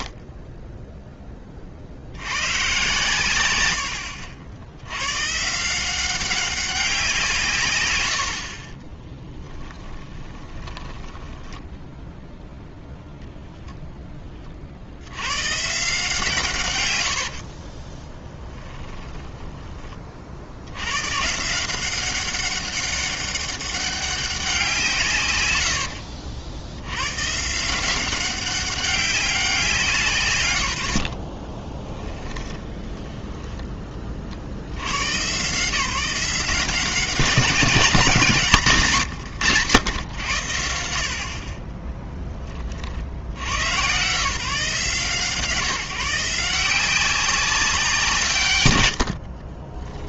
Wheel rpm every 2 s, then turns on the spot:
70, 10, 90, 130, 80, 20, 0, 70, 90, 20, 110, 200, 150, 110, 200, 70, 20, 110, 180, 150, 60, 40, 160, 170, 150.
10-12 18-20 30-34